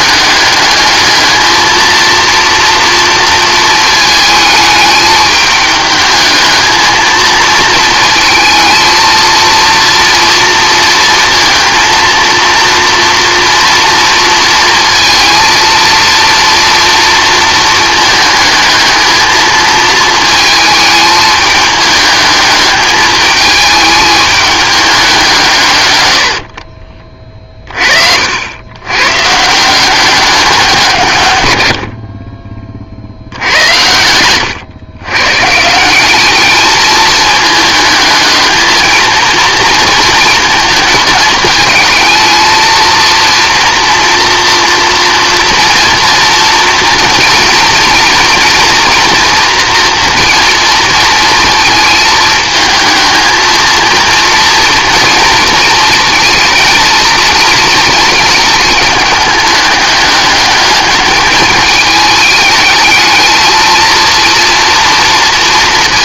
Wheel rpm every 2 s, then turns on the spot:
210, 230, 220, 220, 230, 230, 230, 230, 230, 220, 220, 220, 200, 40, 120, 160, 50, 120, 220, 230, 220, 230, 230, 230, 230, 230, 230, 240, 230, 220, 210, 210, 230.
none